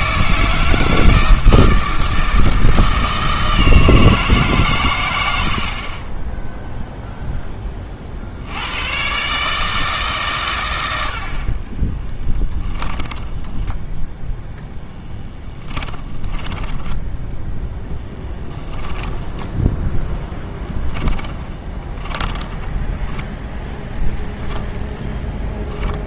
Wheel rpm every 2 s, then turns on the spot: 160, 160, 130, 0, 100, 90, 20, 10, 10, 10, 20, 10, 0.
12-14 16-24